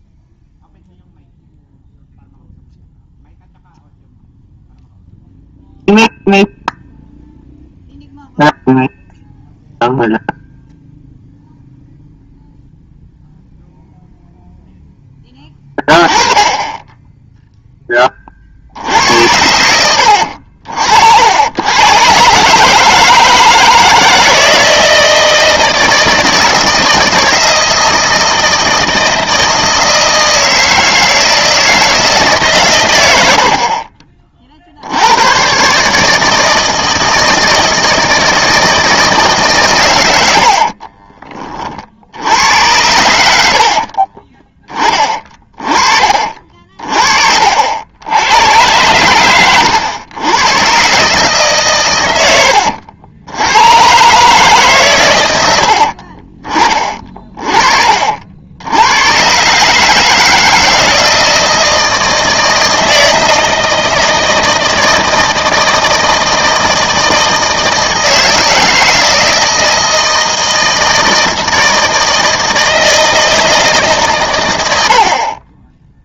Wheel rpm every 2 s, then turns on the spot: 0, 0, 0, 0, 0, 0, 0, 0, 10, 50, 70, 150, 160, 160, 160, 160, 130, 50, 160, 160, 60, 80, 20, 40, 110, 120, 80, 140, 30, 90, 160, 160, 160, 160, 160, 160, 160, 80.
40-42